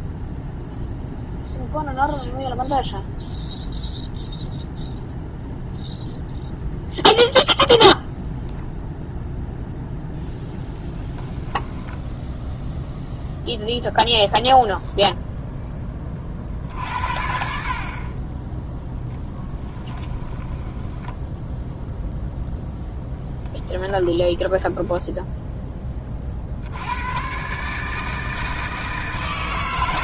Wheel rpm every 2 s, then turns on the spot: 0, 0, 0, 0, 0, 0, 0, 10, 60, 10, 10, 0, 10, 70, 160.
20-22 24-26